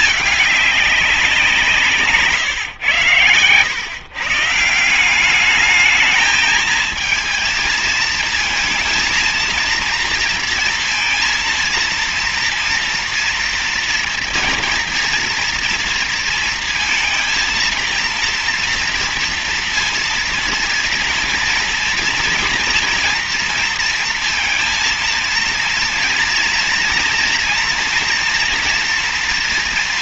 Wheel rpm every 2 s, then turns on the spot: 210, 140, 150, 220, 230, 230, 240, 230, 230, 230, 230, 240, 230, 230, 230.
none